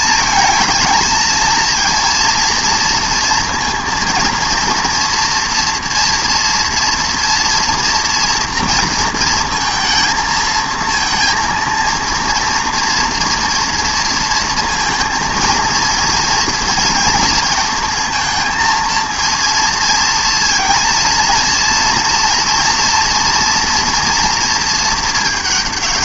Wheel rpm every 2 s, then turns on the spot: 220, 230, 230, 230, 230, 220, 230, 230, 230, 230, 230, 230, 230.
none